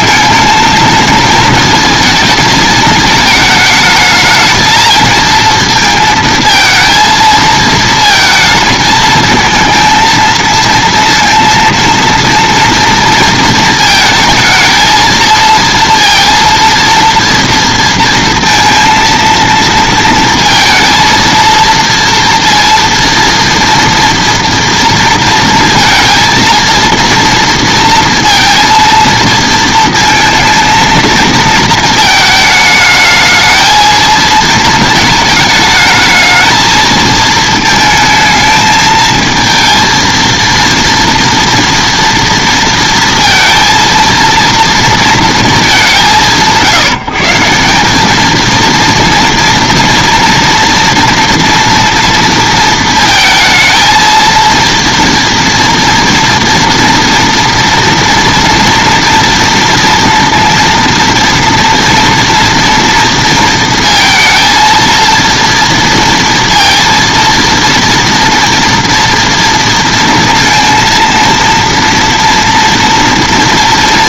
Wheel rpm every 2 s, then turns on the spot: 220, 220, 220, 230, 220, 230, 230, 220, 230, 230, 230, 230, 230, 230, 230, 230, 220, 230, 220, 220, 230, 230, 230, 170, 230, 240, 230, 230, 230, 230, 230, 230, 230, 230, 240, 230, 230.
none